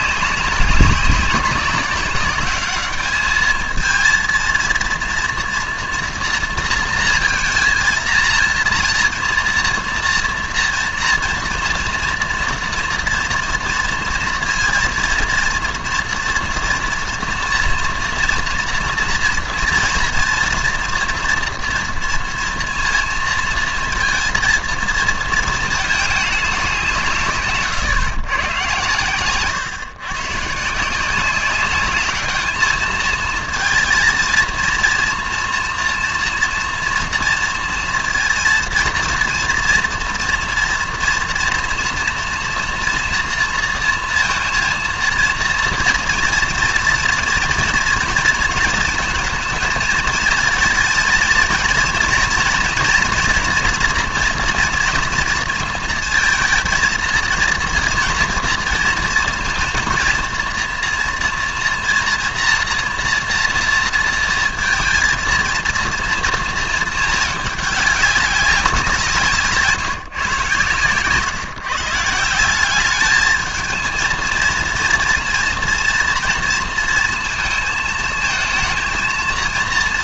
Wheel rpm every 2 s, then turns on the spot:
200, 200, 230, 230, 230, 230, 230, 230, 230, 240, 230, 230, 230, 190, 120, 150, 220, 230, 230, 230, 230, 230, 230, 230, 230, 220, 230, 240, 230, 230, 230, 240, 230, 230, 190, 130, 190, 230, 230, 230.
70-72